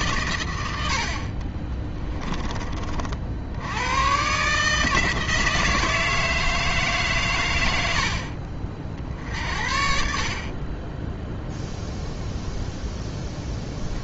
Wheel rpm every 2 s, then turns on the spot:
80, 40, 160, 150, 40, 20, 0.
none